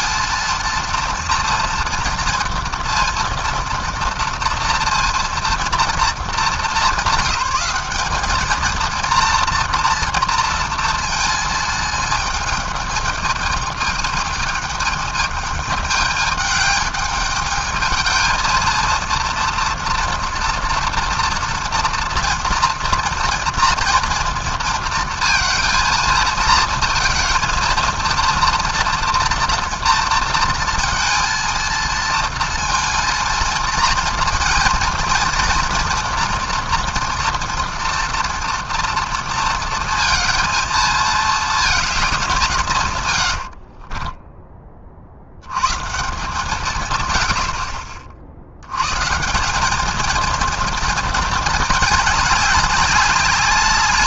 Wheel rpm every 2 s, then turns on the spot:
230, 230, 230, 200, 220, 230, 220, 210, 210, 220, 240, 230, 230, 230, 230, 230, 230, 230, 230, 230, 220, 160, 20, 150, 90, 230, 200.
none